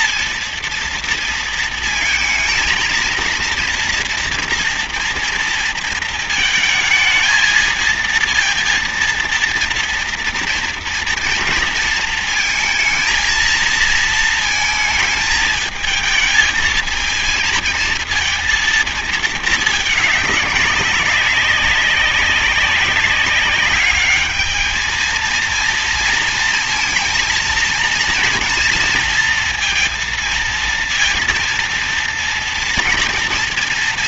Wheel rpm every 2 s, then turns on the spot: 230, 230, 240, 220, 230, 230, 220, 220, 220, 220, 190, 190, 220, 230, 230, 230, 230.
none